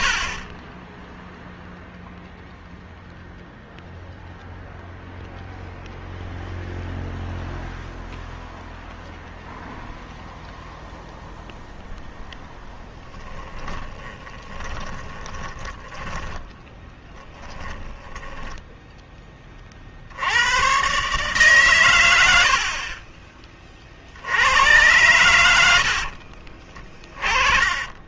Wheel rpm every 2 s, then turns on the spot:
50, 0, 0, 0, 0, 0, 10, 20, 10, 10, 100, 60, 90, 50.
0-2 14-20 26-28